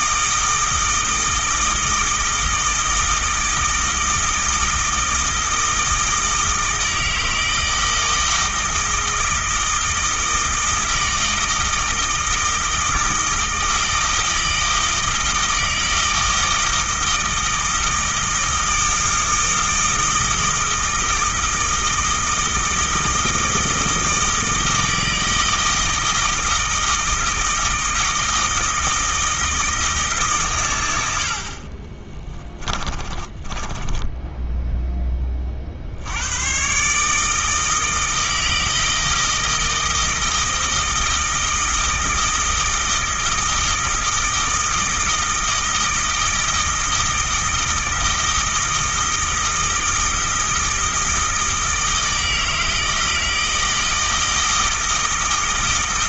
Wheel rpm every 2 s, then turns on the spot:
160, 160, 160, 160, 160, 160, 160, 160, 160, 160, 160, 160, 160, 160, 160, 110, 20, 10, 120, 160, 160, 160, 160, 160, 160, 160, 160, 160.
32-34